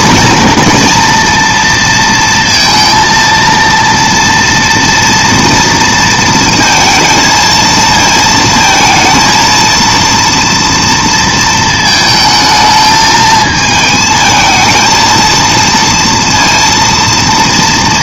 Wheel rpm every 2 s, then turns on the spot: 230, 230, 230, 220, 230, 230, 220, 230, 230.
none